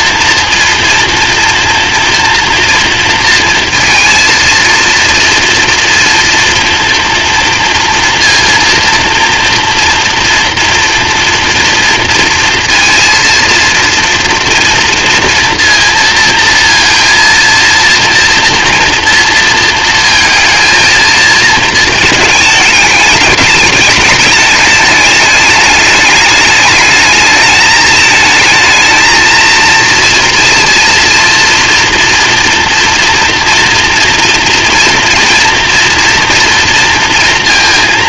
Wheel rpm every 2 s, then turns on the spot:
230, 230, 230, 240, 230, 240, 230, 230, 230, 230, 220, 210, 210, 210, 220, 230, 230, 240, 230.
none